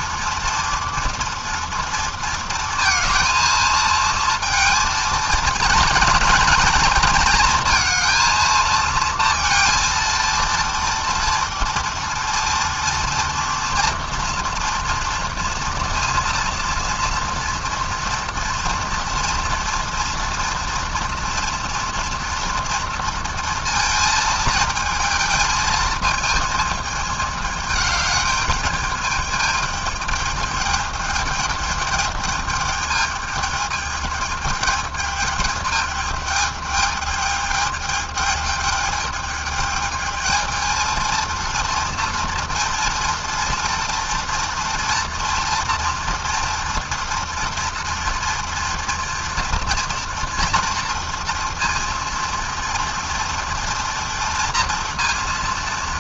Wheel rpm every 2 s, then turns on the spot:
230, 220, 220, 220, 230, 230, 240, 230, 230, 230, 230, 230, 220, 210, 210, 210, 210, 210, 210, 210, 230, 230, 230, 230, 230, 240, 240, 230.
none